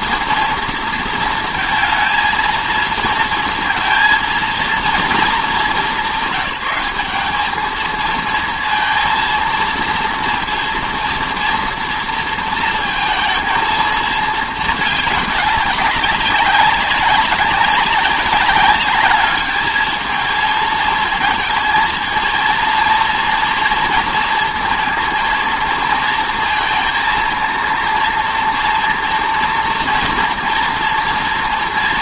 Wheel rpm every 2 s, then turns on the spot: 230, 220, 230, 200, 230, 230, 230, 210, 200, 200, 220, 230, 230, 230, 230, 230.
none